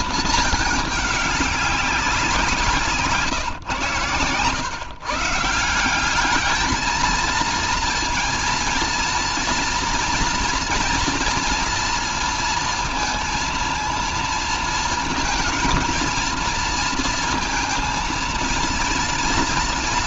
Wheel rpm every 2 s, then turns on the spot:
210, 160, 130, 220, 230, 230, 230, 230, 230, 230.
none